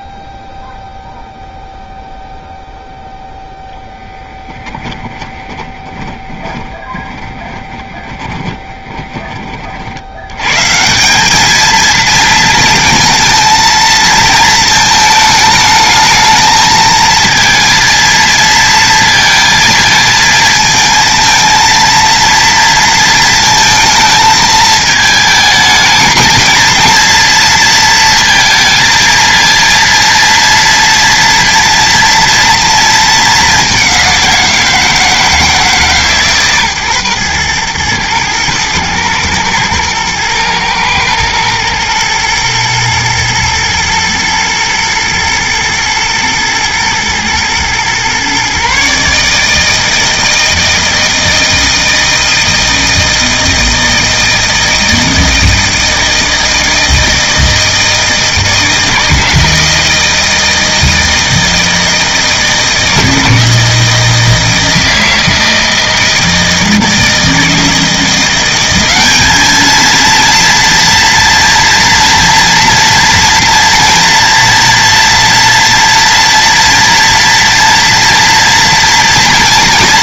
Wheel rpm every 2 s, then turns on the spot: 0, 0, 10, 20, 20, 160, 230, 220, 220, 230, 230, 230, 220, 230, 230, 230, 220, 170, 130, 110, 110, 110, 110, 120, 140, 160, 160, 160, 160, 160, 160, 160, 160, 160, 200, 240, 240, 230, 230, 240.
4-10